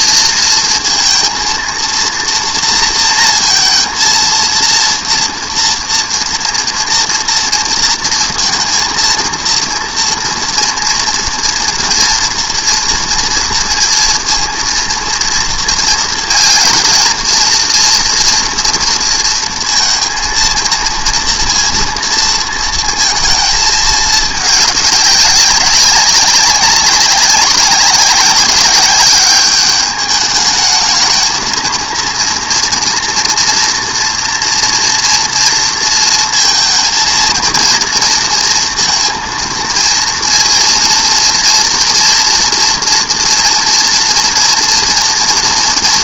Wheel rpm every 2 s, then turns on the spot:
230, 230, 230, 230, 230, 230, 240, 230, 230, 230, 230, 230, 210, 190, 190, 220, 230, 230, 230, 230, 230, 240, 240.
none